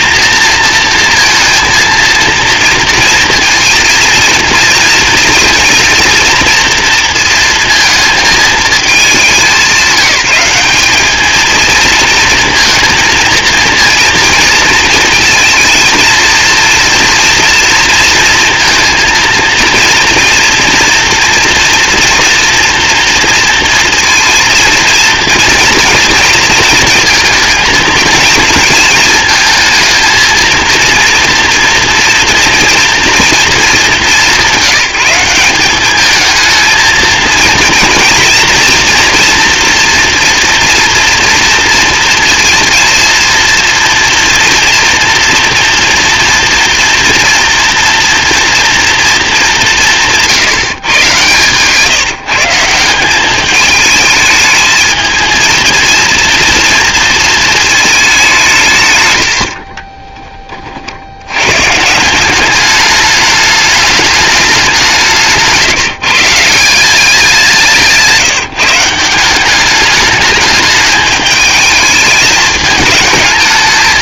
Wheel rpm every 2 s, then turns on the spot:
230, 230, 230, 230, 210, 200, 230, 230, 230, 230, 230, 230, 230, 230, 230, 230, 230, 200, 220, 240, 230, 230, 230, 240, 230, 140, 160, 220, 230, 140, 40, 200, 200, 170, 160, 210, 210.
none